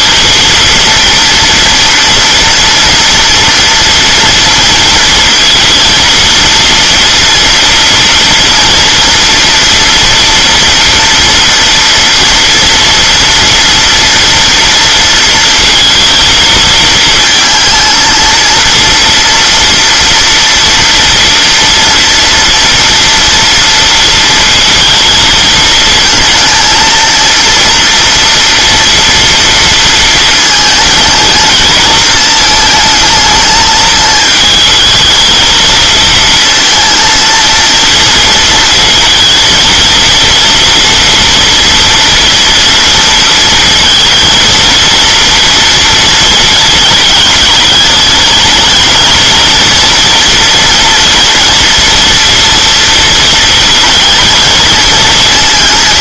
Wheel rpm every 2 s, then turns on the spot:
230, 230, 230, 230, 230, 230, 240, 230, 220, 230, 230, 230, 230, 230, 230, 230, 220, 220, 230, 220, 230, 230, 230, 220, 220, 240, 230, 220.
none